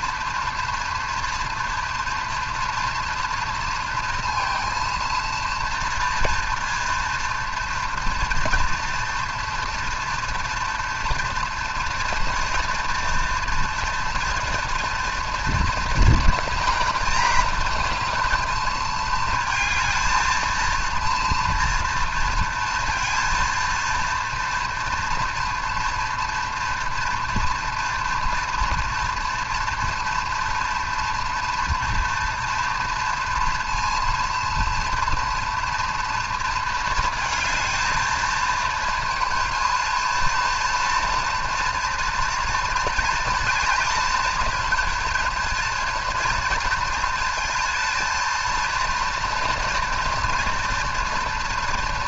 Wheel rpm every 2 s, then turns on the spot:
230, 230, 230, 230, 230, 230, 230, 230, 230, 220, 220, 230, 230, 230, 230, 230, 230, 230, 230, 220, 230, 230, 240, 230, 230, 230.
none